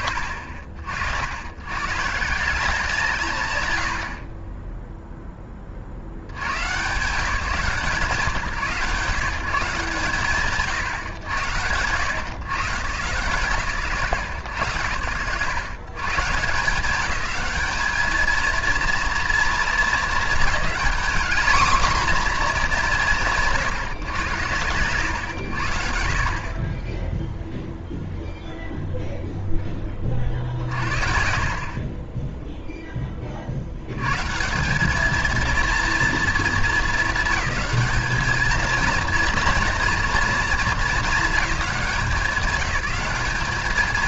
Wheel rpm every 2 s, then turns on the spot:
70, 180, 0, 140, 150, 120, 120, 100, 200, 230, 220, 180, 120, 20, 0, 50, 10, 200, 220, 230, 230, 190.
none